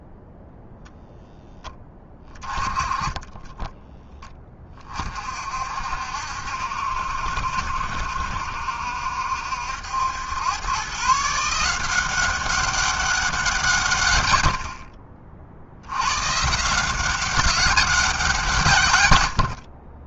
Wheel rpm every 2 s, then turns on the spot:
10, 20, 50, 70, 70, 150, 190, 50, 190, 90.
2-4